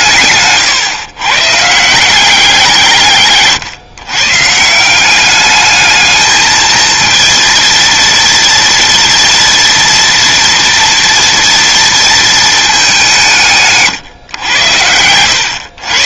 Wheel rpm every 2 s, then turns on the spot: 130, 140, 190, 230, 230, 230, 180, 110.
none